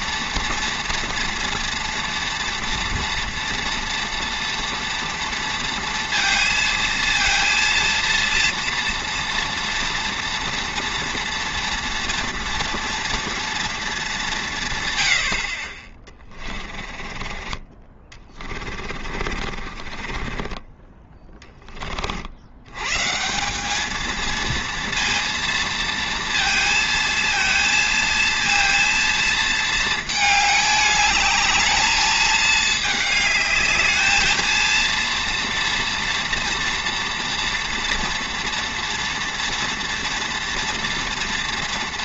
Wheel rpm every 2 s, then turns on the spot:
230, 230, 230, 230, 230, 230, 240, 160, 30, 30, 20, 100, 230, 230, 230, 210, 220, 220, 230, 230, 230.
16-22